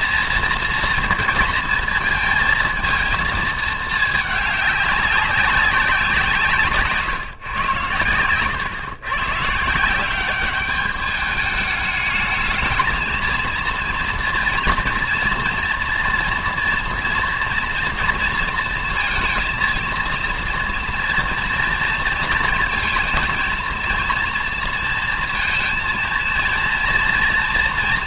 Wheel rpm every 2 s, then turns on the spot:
230, 220, 210, 170, 110, 200, 220, 230, 240, 230, 230, 230, 230, 230.
none